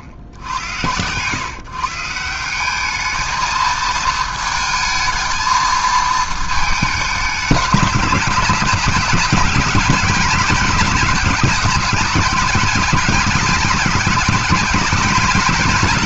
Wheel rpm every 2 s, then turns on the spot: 70, 190, 220, 220, 180, 200, 190, 200.
none